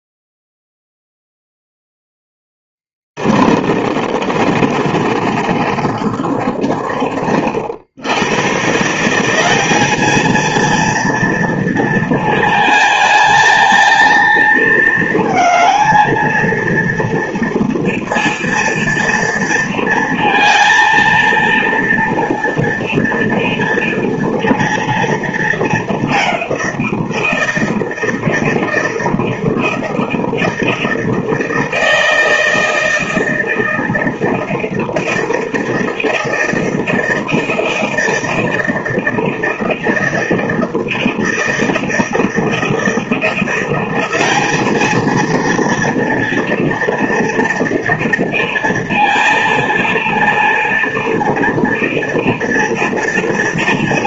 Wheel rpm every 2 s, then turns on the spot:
0, 10, 30, 40, 130, 230, 220, 220, 230, 230, 230, 230, 230, 180, 160, 160, 160, 160, 160, 160, 160, 160, 210, 230, 230, 230, 230.
2-8